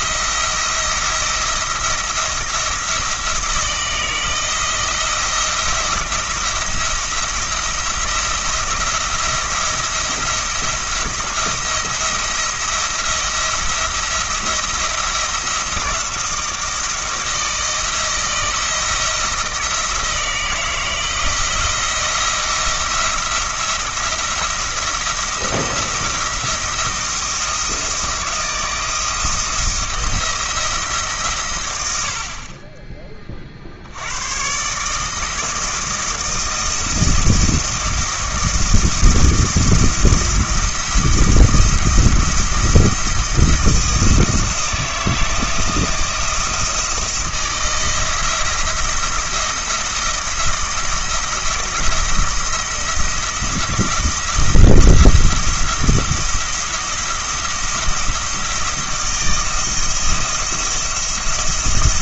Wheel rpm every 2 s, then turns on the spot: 170, 170, 170, 170, 170, 170, 170, 170, 160, 170, 160, 170, 170, 170, 170, 160, 20, 140, 160, 160, 170, 170, 160, 160, 170, 170, 170, 170, 170, 160, 170.
none